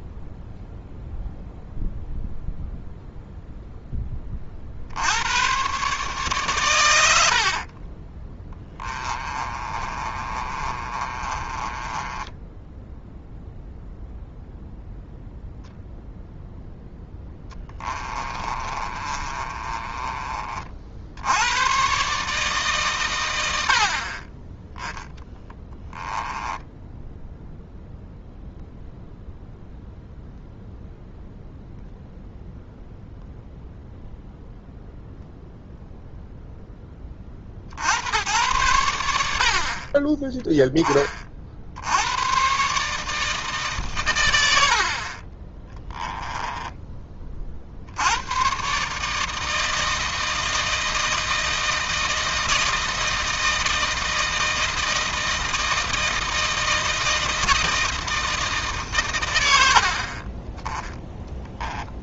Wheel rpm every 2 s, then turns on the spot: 0, 0, 60, 110, 20, 30, 10, 0, 0, 30, 50, 130, 10, 10, 0, 0, 0, 0, 10, 90, 20, 140, 50, 20, 140, 160, 160, 160, 160, 130, 10.
8-14 18-20 26-28 44-46